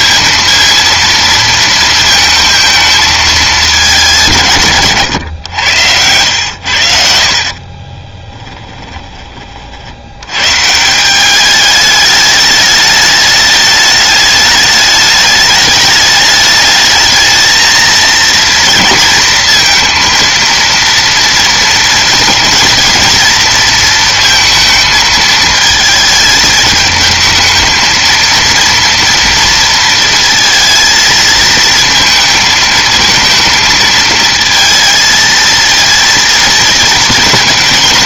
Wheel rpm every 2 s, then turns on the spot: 230, 210, 100, 50, 20, 190, 210, 210, 220, 220, 230, 230, 220, 220, 230, 220, 230, 220, 220.
none